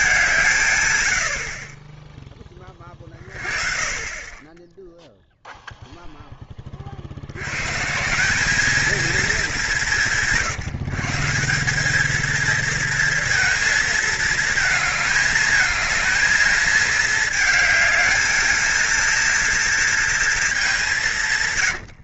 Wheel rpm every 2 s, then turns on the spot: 140, 20, 20, 20, 200, 160, 220, 220, 220, 220, 210.
none